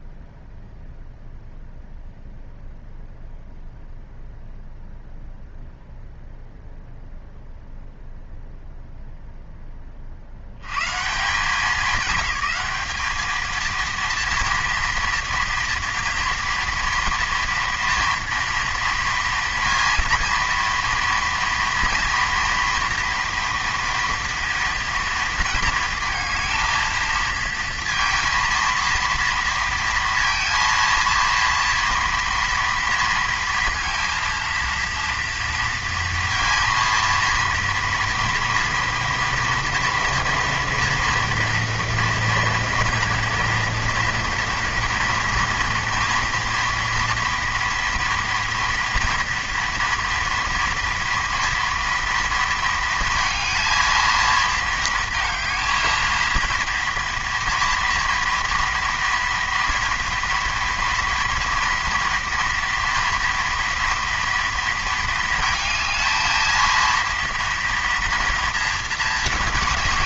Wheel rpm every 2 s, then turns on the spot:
0, 0, 0, 0, 0, 160, 210, 230, 240, 230, 230, 230, 230, 230, 230, 230, 230, 230, 230, 230, 230, 230, 230, 230, 230, 230, 230, 220, 230, 230, 230, 230, 220, 230, 220.
none